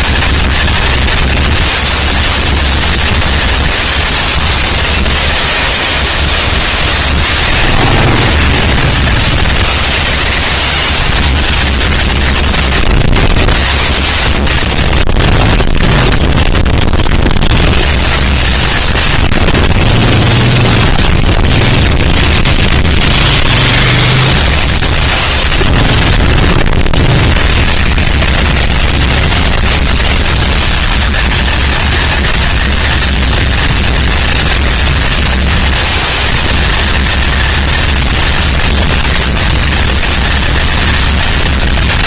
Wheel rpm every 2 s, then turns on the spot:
230, 230, 210, 150, 80, 190, 160, 110, 20, 130, 10, 20, 70, 30, 120, 190, 230, 230, 230, 230, 230.
22-24 26-28